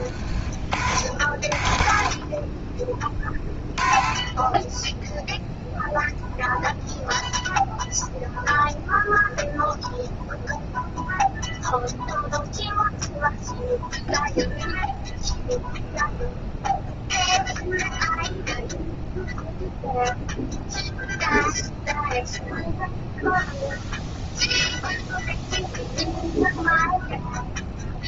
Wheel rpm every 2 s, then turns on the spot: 50, 30, 10, 0, 0, 0, 0, 0, 0, 0, 0, 0, 0, 0.
none